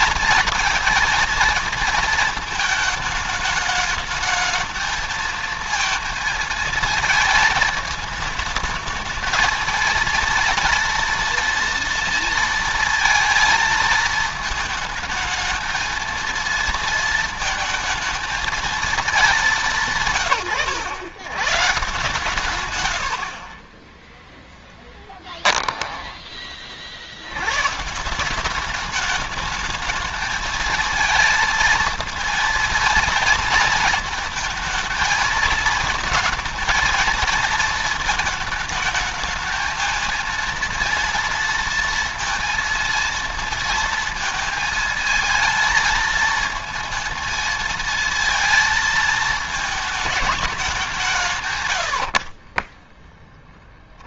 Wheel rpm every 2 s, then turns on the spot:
230, 220, 220, 230, 220, 230, 230, 220, 230, 220, 110, 100, 10, 50, 200, 220, 230, 220, 230, 220, 230, 230, 220, 220, 220, 180, 20.
none